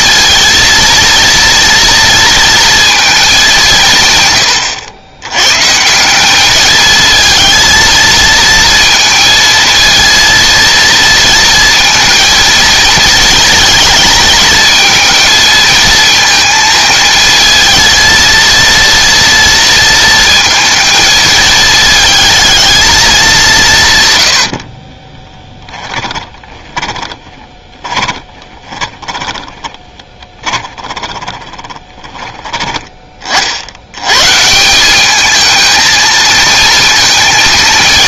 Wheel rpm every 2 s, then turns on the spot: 230, 230, 110, 210, 230, 230, 230, 220, 230, 230, 230, 220, 60, 20, 20, 20, 20, 160, 230.
24-32